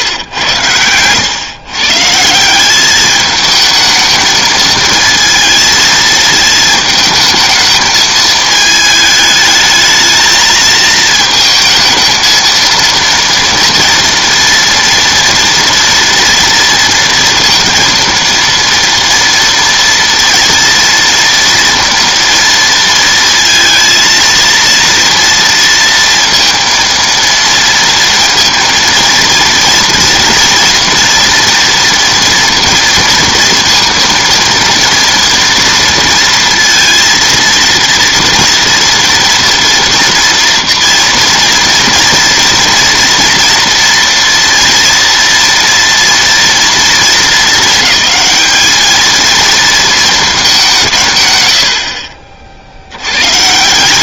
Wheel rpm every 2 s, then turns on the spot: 100, 180, 220, 220, 220, 220, 230, 230, 230, 230, 230, 230, 230, 230, 230, 230, 230, 230, 230, 240, 230, 240, 230, 230, 220, 200, 60.
none